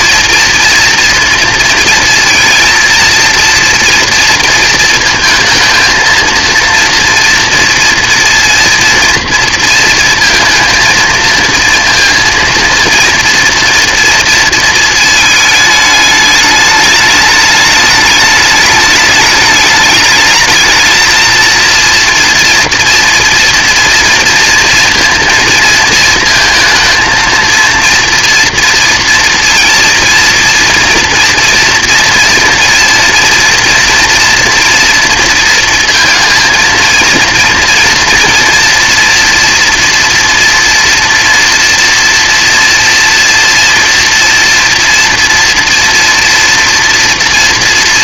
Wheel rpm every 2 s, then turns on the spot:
230, 230, 230, 230, 230, 230, 230, 220, 210, 210, 220, 230, 230, 220, 230, 230, 230, 230, 230, 230, 230, 230, 230, 230.
none